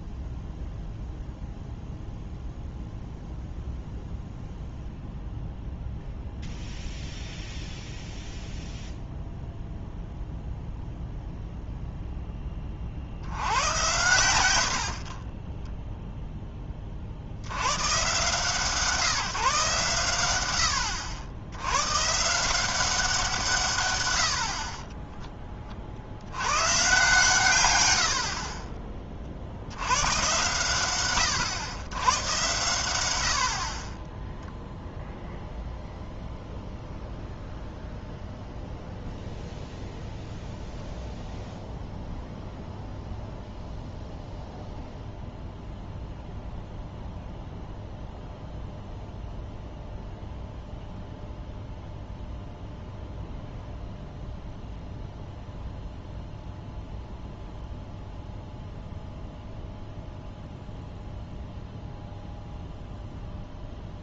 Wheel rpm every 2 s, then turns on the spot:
0, 0, 0, 0, 0, 0, 30, 70, 20, 140, 90, 180, 40, 120, 30, 110, 100, 0, 0, 0, 0, 0, 0, 0, 0, 0, 0, 0, 0, 0, 0, 0.
none